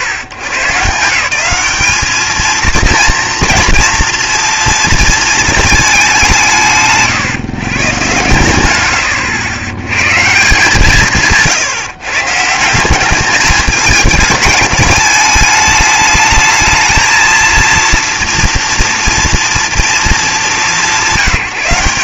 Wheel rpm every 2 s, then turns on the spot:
130, 230, 230, 130, 70, 180, 170, 220, 220, 230, 170.
none